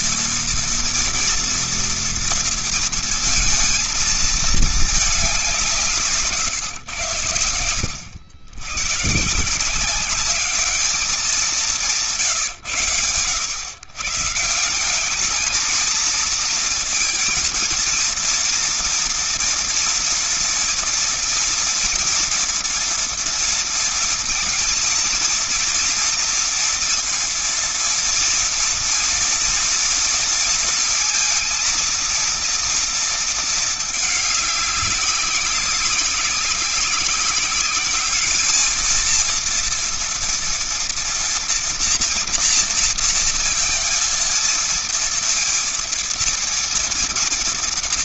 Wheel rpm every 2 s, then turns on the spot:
230, 230, 220, 130, 100, 200, 130, 150, 230, 230, 230, 240, 230, 230, 230, 230, 230, 210, 190, 210, 230, 230, 230, 230.
none